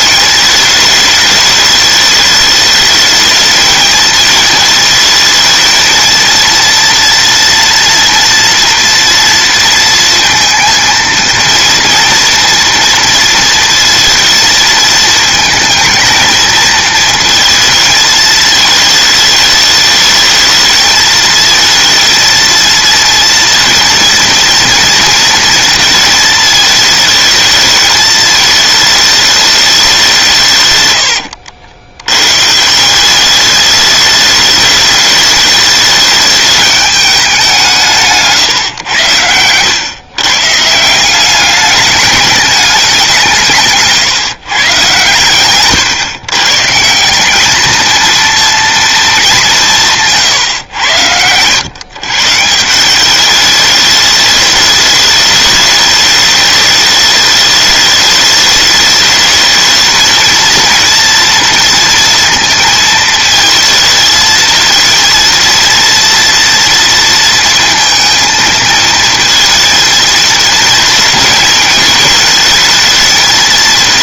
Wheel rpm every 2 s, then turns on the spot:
220, 210, 220, 220, 230, 230, 230, 230, 220, 220, 210, 220, 230, 220, 220, 180, 110, 210, 210, 160, 130, 210, 150, 120, 230, 150, 130, 210, 210, 210, 230, 230, 230, 230, 230, 230, 220.
50-52